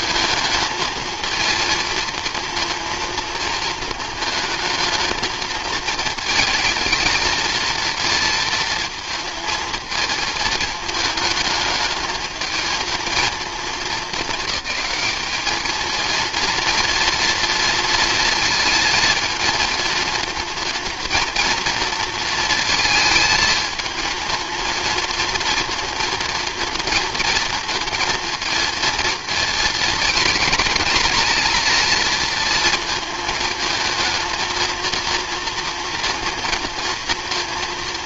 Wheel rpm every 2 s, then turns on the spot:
220, 230, 220, 220, 230, 220, 220, 210, 230, 220, 230, 220, 230, 230, 230, 230, 230, 230, 230.
none